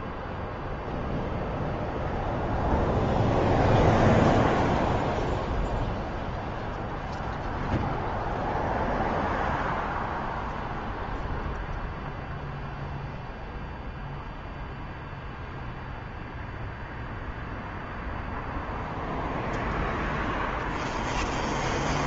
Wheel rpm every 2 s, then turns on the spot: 0, 0, 0, 0, 0, 0, 0, 0, 0, 0, 30.
none